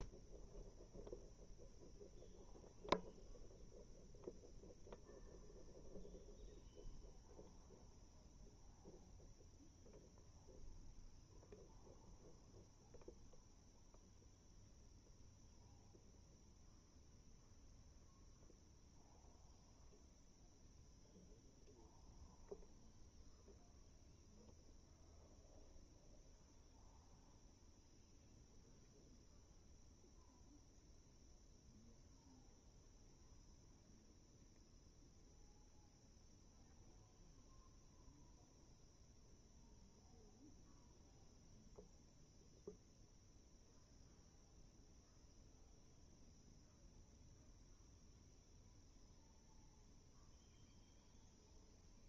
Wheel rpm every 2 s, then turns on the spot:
0, 0, 0, 0, 0, 0, 0, 0, 0, 0, 0, 0, 0, 0, 0, 0, 0, 0, 0, 0, 0, 0, 0, 0, 0, 0.
none